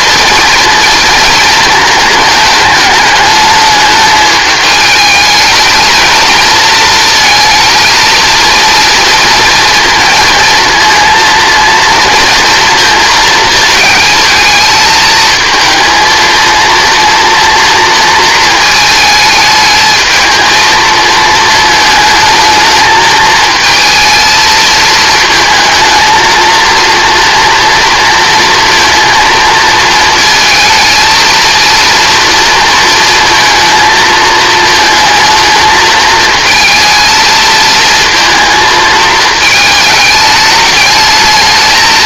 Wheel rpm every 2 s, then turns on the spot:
230, 220, 210, 230, 230, 230, 230, 220, 230, 220, 220, 220, 220, 230, 230, 230, 230, 220, 230, 230, 210.
none